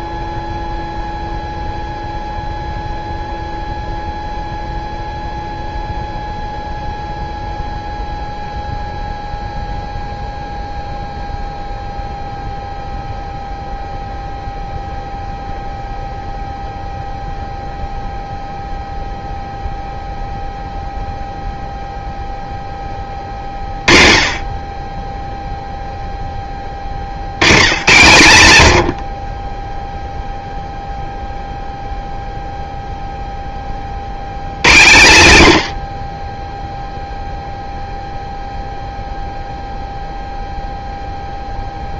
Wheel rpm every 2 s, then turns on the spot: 0, 0, 0, 0, 0, 0, 0, 0, 0, 0, 0, 10, 40, 20, 100, 0, 0, 110, 10, 0, 0.
none